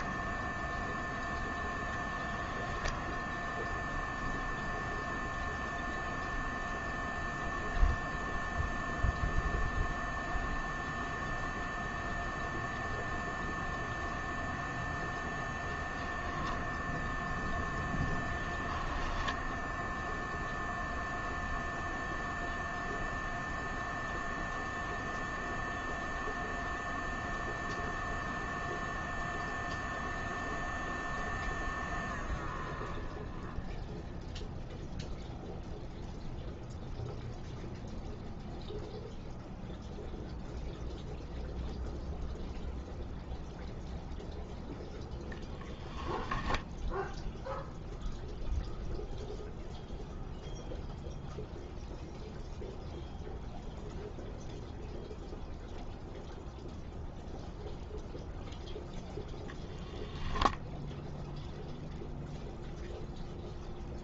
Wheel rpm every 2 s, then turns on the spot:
0, 0, 0, 0, 0, 0, 0, 0, 0, 10, 0, 0, 0, 0, 0, 0, 0, 0, 0, 0, 0, 0, 0, 0, 0, 0, 0, 0, 0, 10, 0, 0.
none